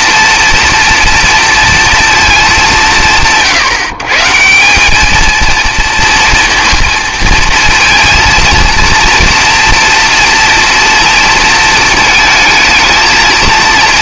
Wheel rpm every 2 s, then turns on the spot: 230, 180, 200, 230, 230, 240, 230.
none